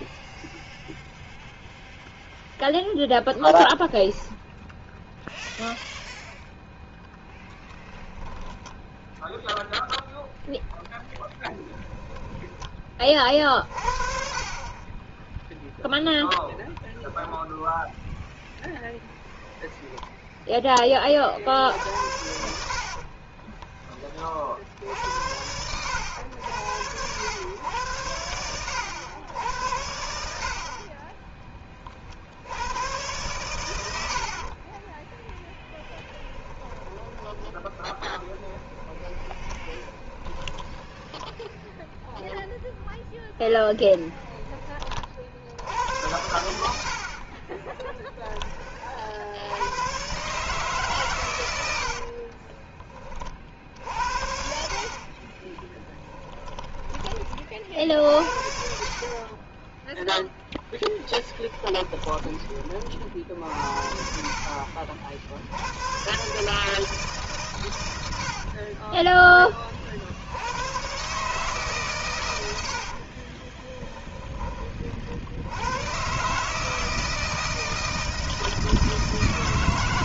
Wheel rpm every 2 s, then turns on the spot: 0, 0, 0, 0, 10, 0, 20, 30, 10, 0, 10, 70, 50, 100, 100, 30, 90, 40, 20, 20, 10, 0, 30, 80, 40, 140, 30, 60, 20, 50, 10, 30, 50, 150, 40, 110, 70, 40, 150, 160.
22-24 34-42 52-56 60-62 68-70 72-74